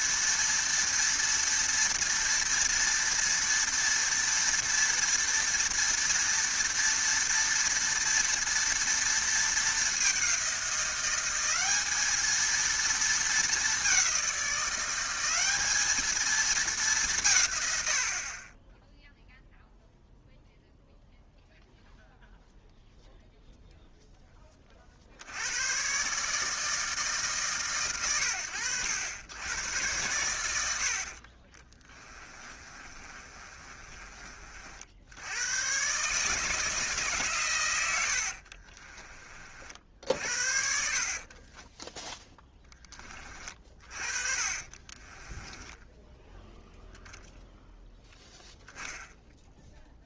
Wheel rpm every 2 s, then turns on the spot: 230, 230, 230, 230, 230, 190, 230, 180, 210, 20, 0, 0, 40, 150, 80, 90, 30, 50, 160, 40, 60, 10, 40, 0, 10.
32-34 38-42 44-46